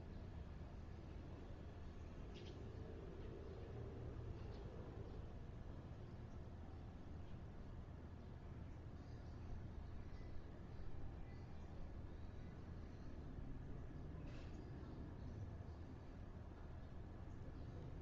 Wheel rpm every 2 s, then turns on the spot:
0, 0, 0, 0, 0, 0, 0, 0, 0.
none